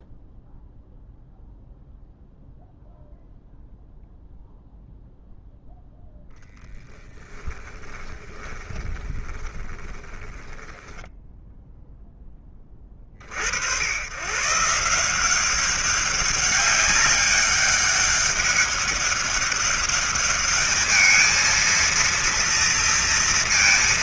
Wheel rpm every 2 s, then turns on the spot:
0, 0, 0, 10, 20, 10, 40, 160, 200, 200, 220, 230.
6-12